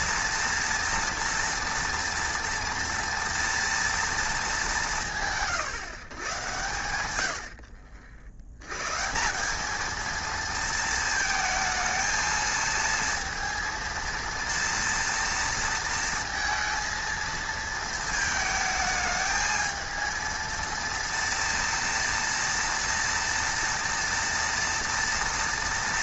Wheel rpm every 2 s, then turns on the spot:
230, 230, 190, 100, 140, 220, 230, 230, 230, 220, 230, 230, 230.
none